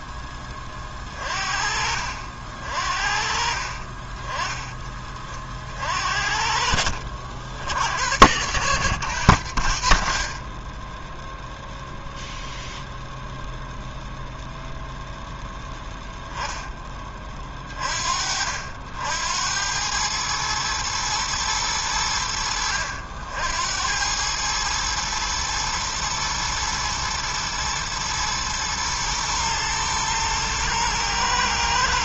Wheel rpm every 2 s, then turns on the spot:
20, 50, 20, 70, 100, 10, 0, 0, 10, 70, 110, 80, 110, 110, 110, 120.
none